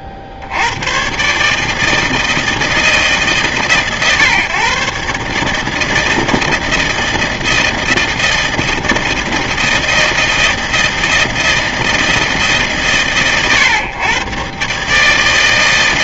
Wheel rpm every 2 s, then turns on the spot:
80, 160, 130, 160, 160, 160, 150, 130.
none